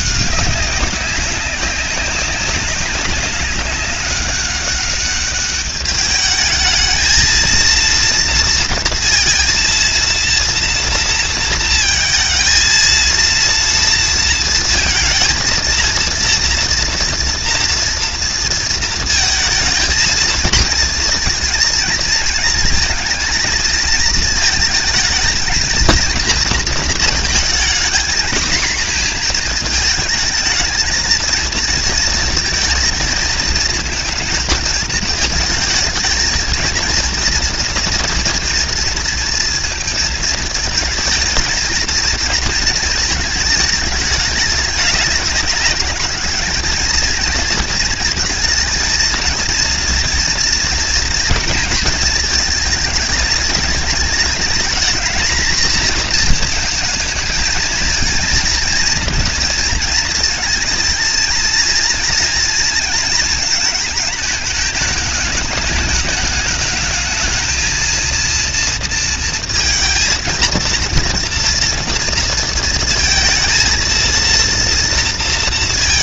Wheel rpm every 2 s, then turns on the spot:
200, 190, 200, 220, 230, 230, 230, 230, 230, 230, 230, 230, 230, 230, 240, 220, 230, 220, 230, 230, 230, 220, 200, 220, 220, 230, 220, 230, 220, 230, 230, 230, 210, 220, 230, 230, 230, 230.
none